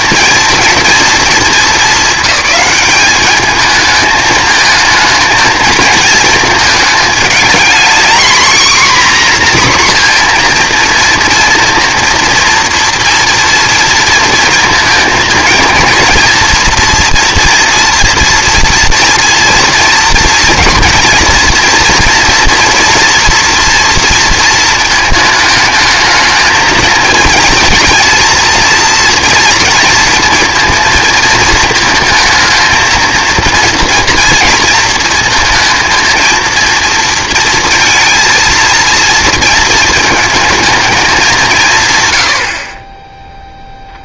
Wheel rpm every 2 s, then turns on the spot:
230, 200, 220, 220, 250, 230, 230, 220, 230, 230, 230, 230, 220, 220, 230, 230, 230, 230, 230, 220, 210, 50.
none